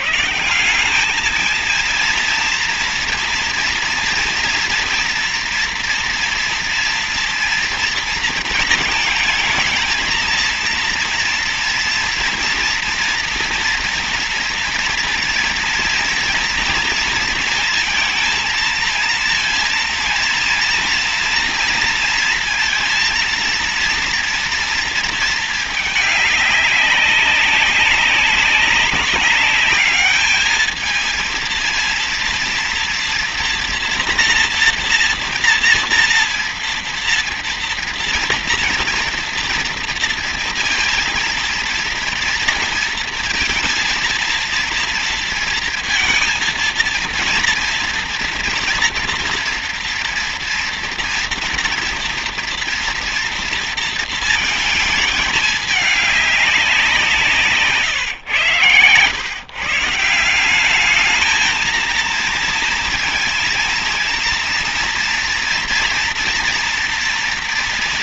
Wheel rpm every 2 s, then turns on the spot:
170, 230, 230, 240, 220, 230, 230, 230, 230, 230, 230, 230, 230, 200, 200, 220, 230, 230, 230, 230, 230, 230, 230, 230, 230, 230, 230, 220, 190, 120, 200, 230, 230, 230.
none